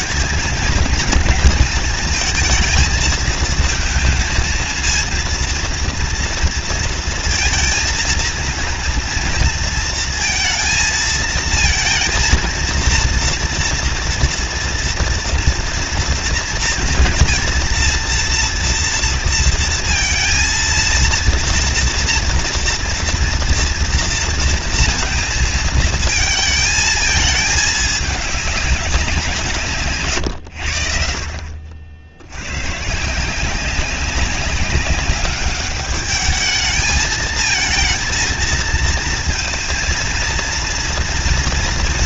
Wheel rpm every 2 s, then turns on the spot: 230, 220, 230, 230, 230, 220, 230, 230, 230, 230, 230, 230, 230, 220, 170, 60, 170, 200, 220, 230, 230.
none